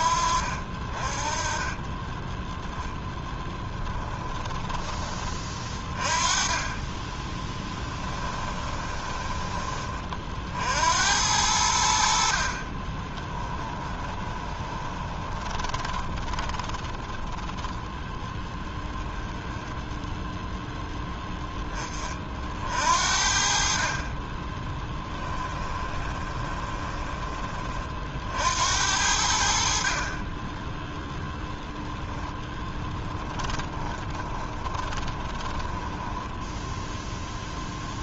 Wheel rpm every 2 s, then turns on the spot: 40, 10, 20, 30, 30, 70, 30, 20, 20, 0, 0, 50, 20, 20, 80, 10, 20, 30, 0.
8-10 12-18 24-28 30-36